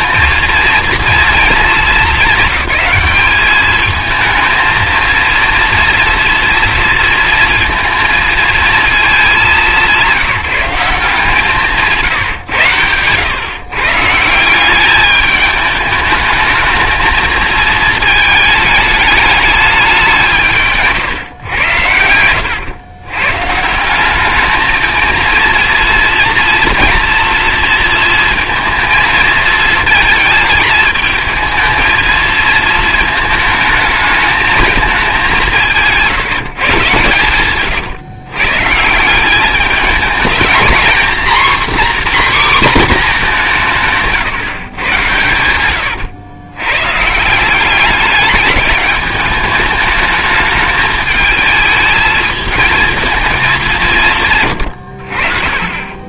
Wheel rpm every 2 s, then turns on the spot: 230, 210, 220, 230, 230, 180, 110, 180, 220, 210, 160, 110, 220, 230, 220, 220, 220, 220, 160, 150, 230, 260, 130, 110, 210, 210, 220, 120.
none